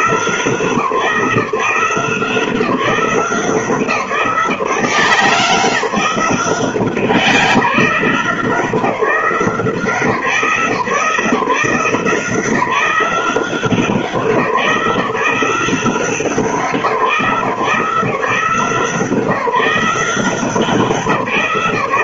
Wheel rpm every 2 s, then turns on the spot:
170, 180, 160, 170, 170, 170, 180, 170, 170, 160, 170.
none